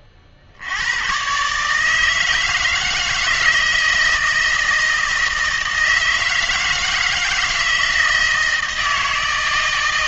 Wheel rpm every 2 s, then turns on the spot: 90, 160, 160, 160, 160.
none